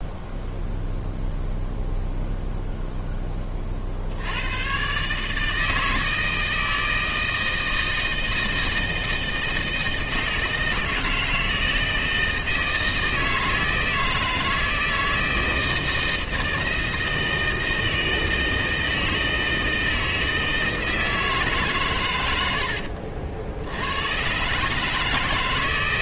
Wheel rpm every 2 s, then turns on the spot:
0, 10, 130, 160, 160, 160, 160, 160, 160, 160, 160, 80, 150.
22-24